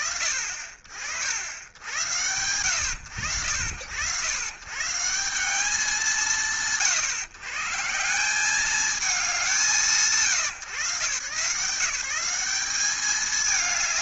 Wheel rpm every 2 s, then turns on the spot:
60, 80, 160, 130, 200, 140, 210.
none